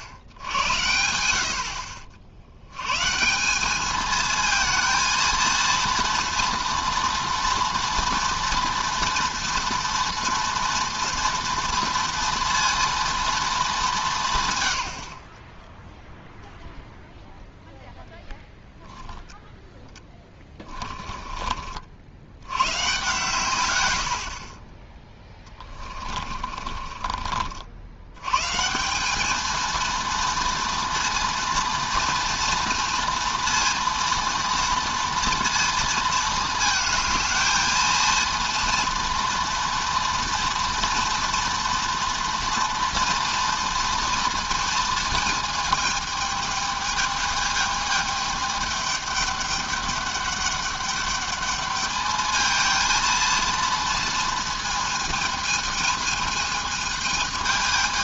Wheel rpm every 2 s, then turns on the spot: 80, 90, 220, 230, 240, 240, 230, 120, 0, 0, 20, 100, 30, 40, 150, 230, 230, 230, 220, 230, 230, 240, 230, 220, 210, 200, 220, 230, 220.
20-22 26-28